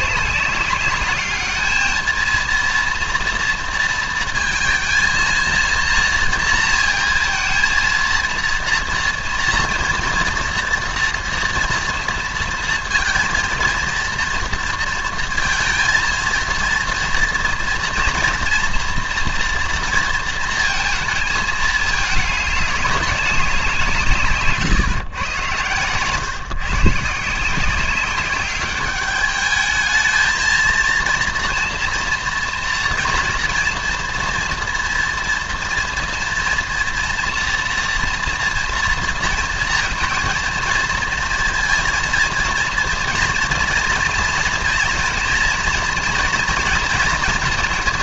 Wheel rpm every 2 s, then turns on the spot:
200, 230, 220, 230, 230, 230, 230, 230, 230, 240, 230, 200, 140, 140, 200, 230, 230, 240, 240, 230, 230, 230, 240, 230.
none